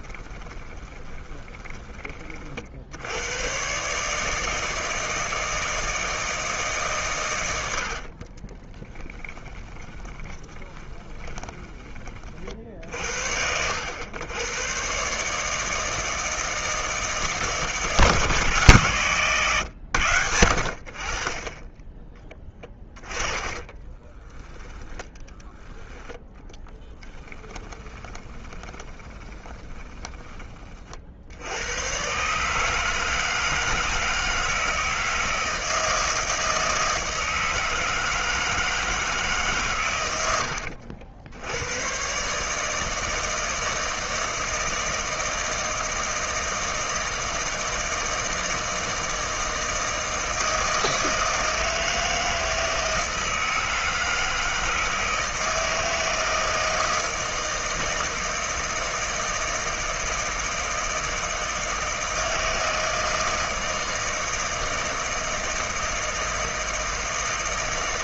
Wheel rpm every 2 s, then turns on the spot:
20, 50, 160, 150, 20, 10, 50, 110, 160, 150, 80, 10, 10, 10, 20, 30, 150, 160, 160, 160, 80, 150, 160, 160, 160, 160, 160, 160, 160, 160, 160, 160, 160, 160.
0-2 8-12 22-30